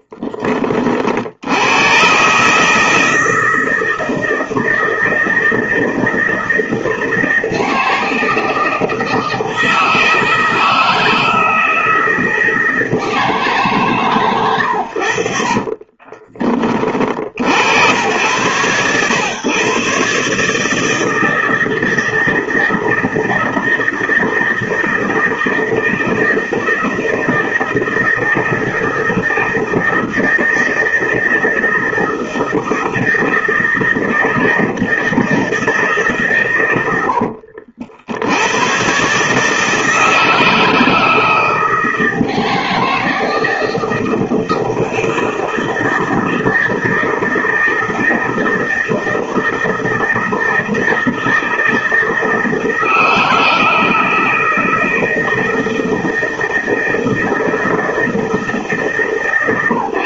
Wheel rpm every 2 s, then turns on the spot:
40, 160, 160, 160, 160, 160, 160, 70, 40, 120, 160, 160, 160, 160, 160, 160, 160, 160, 90, 120, 160, 160, 160, 160, 160, 160, 160, 160, 160, 150.
36-38